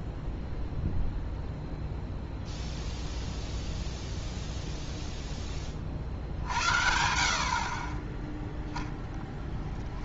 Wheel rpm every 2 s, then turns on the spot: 0, 0, 0, 60, 0.
none